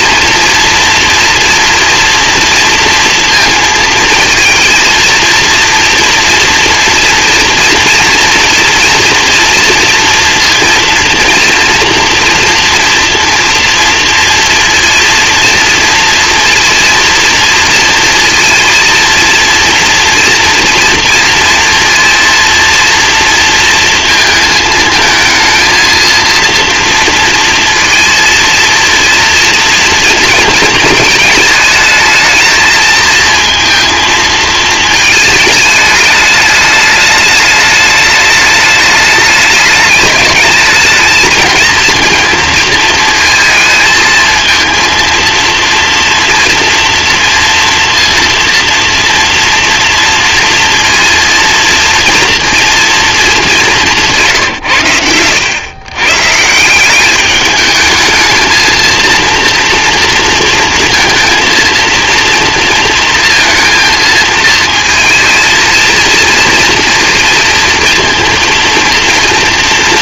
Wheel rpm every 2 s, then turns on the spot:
230, 230, 230, 230, 230, 230, 230, 240, 230, 230, 240, 240, 230, 230, 230, 230, 220, 220, 210, 210, 220, 230, 230, 230, 240, 230, 230, 120, 170, 230, 230, 230, 220, 230, 230.
none